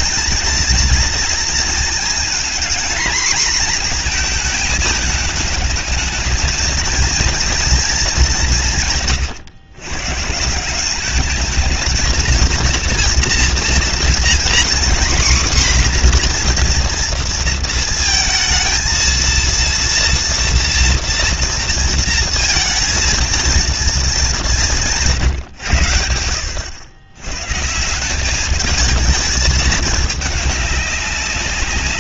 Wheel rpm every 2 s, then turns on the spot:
230, 230, 220, 220, 190, 160, 220, 240, 250, 230, 230, 230, 190, 90, 210, 210.
none